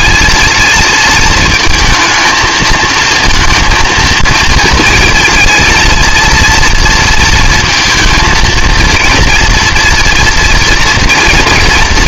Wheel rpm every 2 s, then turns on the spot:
230, 230, 230, 230, 230, 240.
none